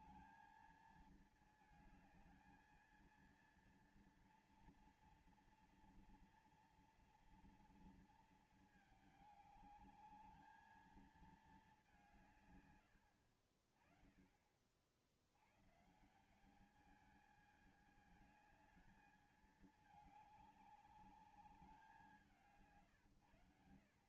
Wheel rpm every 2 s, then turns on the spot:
220, 220, 230, 240, 230, 210, 170, 30, 170, 210, 210, 180.
none